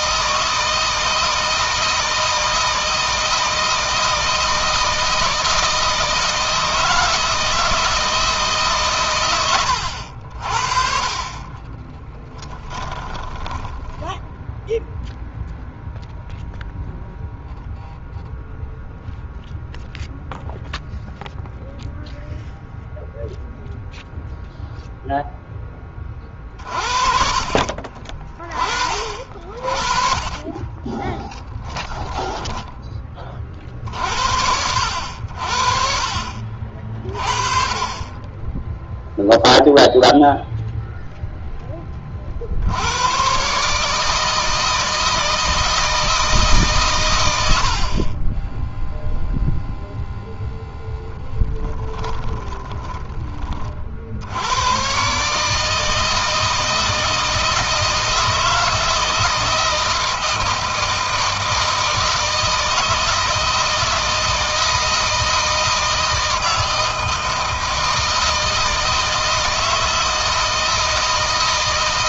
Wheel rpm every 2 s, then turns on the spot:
160, 160, 160, 160, 130, 40, 10, 0, 0, 0, 0, 0, 0, 50, 30, 20, 10, 80, 40, 10, 0, 90, 160, 140, 0, 0, 20, 120, 160, 160, 160, 160, 160, 160, 160, 160.
12-14 30-32